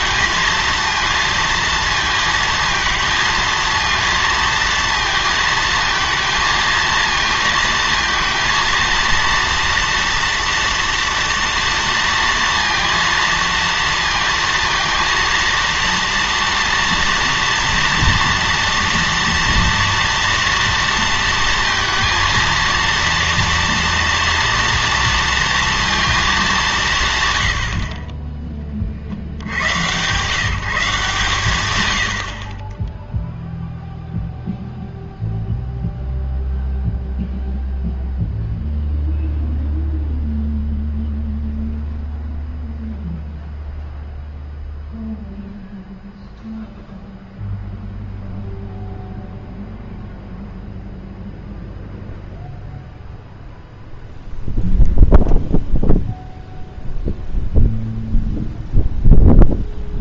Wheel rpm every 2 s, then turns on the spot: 230, 220, 230, 230, 230, 230, 230, 230, 230, 230, 230, 230, 230, 200, 30, 160, 20, 0, 0, 0, 0, 0, 0, 0, 0, 0, 0, 0, 0, 0.
none